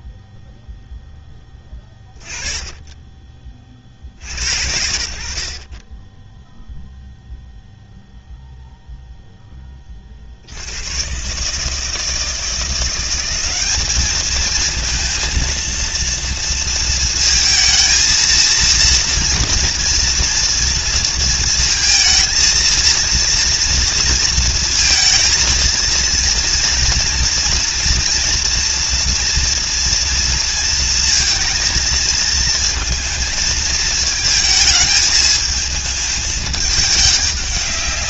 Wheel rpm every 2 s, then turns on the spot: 40, 20, 0, 30, 160, 210, 230, 220, 230, 230, 230, 230, 230, 240, 230, 220, 210, 200, 190.
none